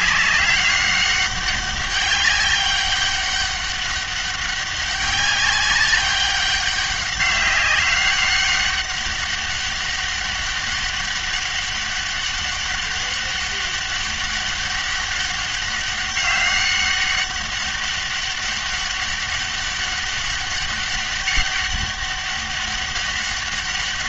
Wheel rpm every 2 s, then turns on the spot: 200, 200, 190, 190, 200, 200, 200, 200, 200, 200, 200, 200.
none